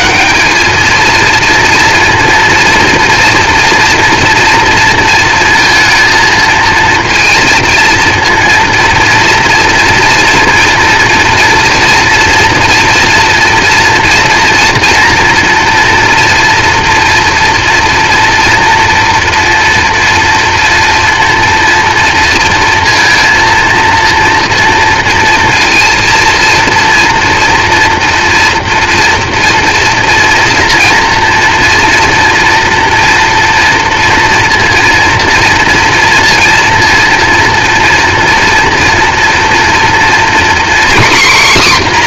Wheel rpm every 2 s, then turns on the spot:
140, 230, 230, 220, 230, 230, 230, 230, 230, 230, 230, 230, 230, 230, 230, 230, 240, 240, 230, 230, 240.
none